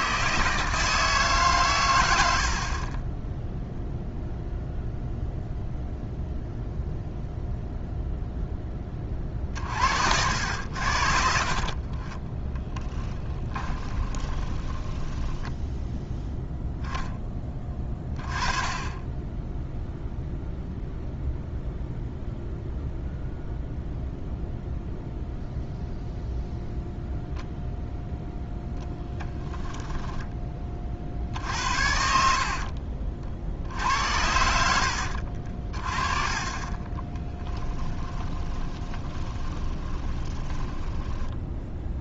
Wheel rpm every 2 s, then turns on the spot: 160, 50, 0, 0, 10, 80, 10, 10, 0, 20, 0, 0, 0, 0, 0, 30, 50, 70, 20, 20, 20.
12-16 32-36 38-42